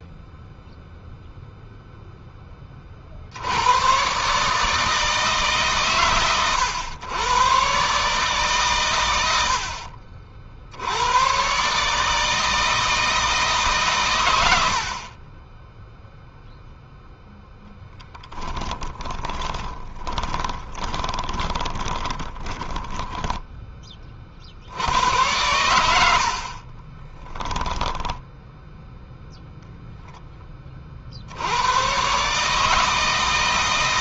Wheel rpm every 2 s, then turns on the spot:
0, 30, 150, 100, 120, 70, 160, 70, 0, 10, 20, 10, 70, 30, 0, 40, 150.
18-24 26-28